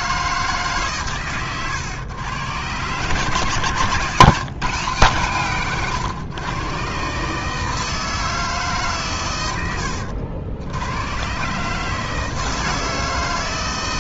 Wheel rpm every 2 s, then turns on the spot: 140, 130, 150, 130, 140, 90, 160.
none